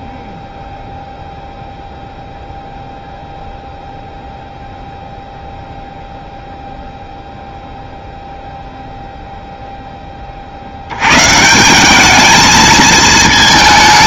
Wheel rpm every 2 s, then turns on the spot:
0, 0, 0, 0, 0, 70, 220.
none